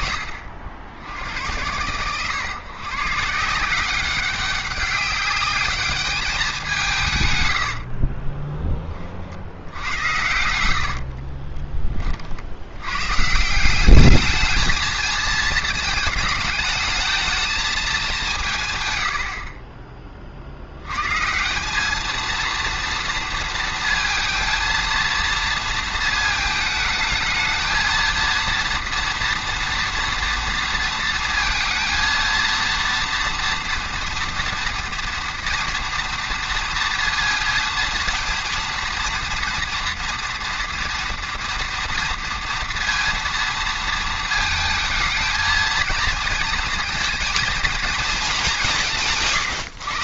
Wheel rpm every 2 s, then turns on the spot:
80, 130, 190, 190, 20, 70, 80, 220, 220, 140, 70, 230, 230, 220, 230, 230, 230, 230, 230, 230, 230, 230, 220, 230, 190.
10-12